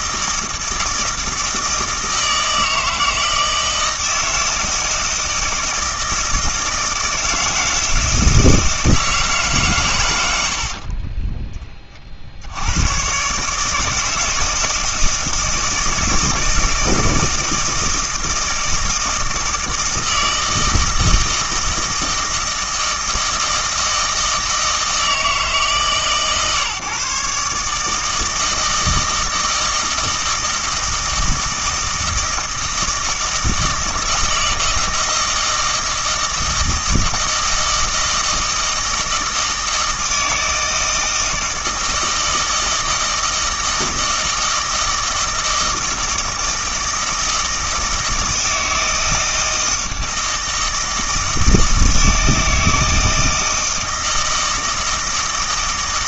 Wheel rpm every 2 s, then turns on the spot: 160, 160, 160, 160, 160, 50, 90, 160, 160, 160, 160, 160, 160, 140, 160, 160, 160, 160, 160, 160, 160, 160, 160, 160, 160, 160, 160, 160.
10-12